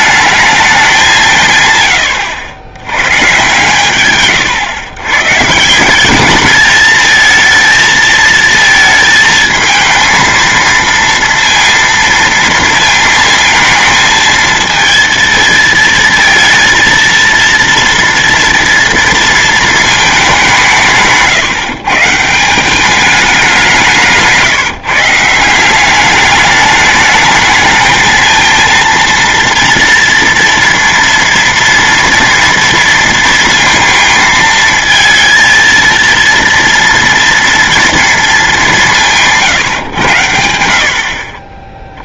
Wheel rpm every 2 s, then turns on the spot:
200, 100, 130, 220, 220, 230, 230, 220, 230, 230, 180, 190, 160, 210, 230, 230, 230, 230, 230, 190, 70.
none